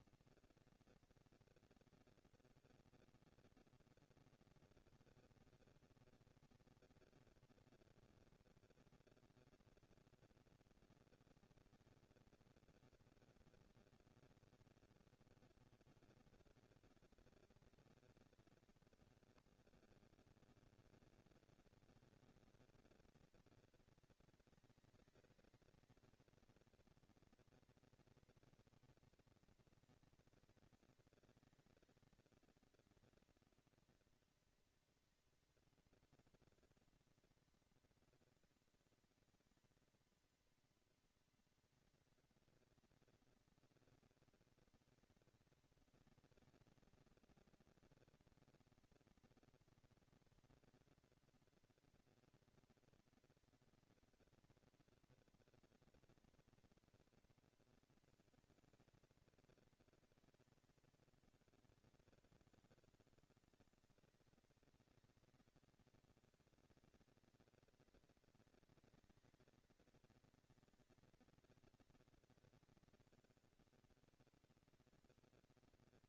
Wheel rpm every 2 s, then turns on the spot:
230, 230, 230, 230, 230, 240, 230, 210, 190, 190, 200, 230, 220, 230, 230, 230, 220, 230, 240, 230, 230, 230, 230, 230, 240, 230, 230, 230, 230, 230, 230, 200, 190, 210, 230, 230, 230, 230.
none